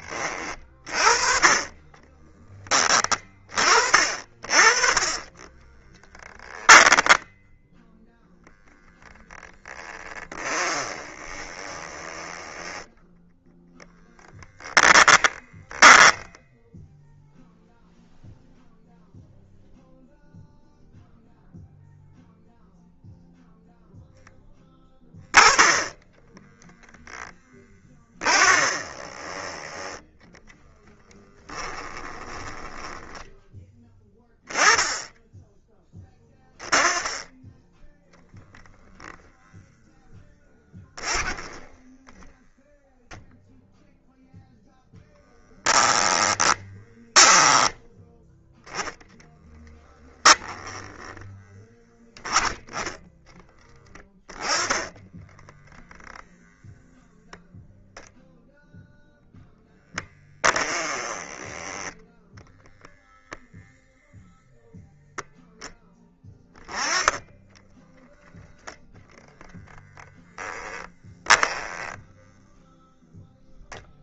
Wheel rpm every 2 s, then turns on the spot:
40, 20, 40, 10, 10, 20, 10, 20, 0, 0, 0, 0, 10, 0, 20, 10, 10, 10, 10, 0, 10, 0, 0, 10, 10, 20, 10, 10, 0, 0, 20, 0, 0, 10, 0, 10, 0.
4-8 10-16 28-34 40-42 46-52 60-62